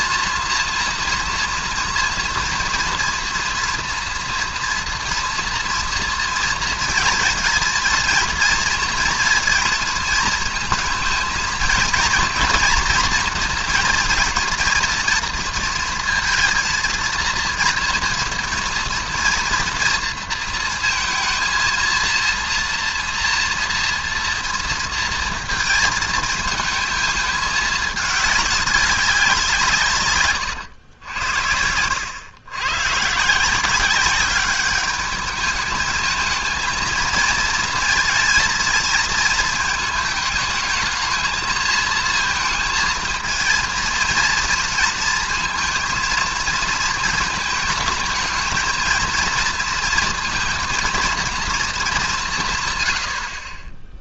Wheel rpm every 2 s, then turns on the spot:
230, 230, 230, 230, 230, 230, 230, 230, 230, 230, 230, 230, 230, 220, 200, 110, 130, 210, 220, 220, 220, 230, 220, 220, 230, 230, 120.
none